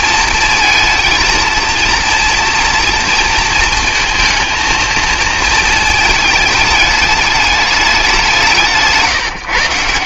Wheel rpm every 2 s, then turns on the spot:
230, 230, 230, 210, 160.
none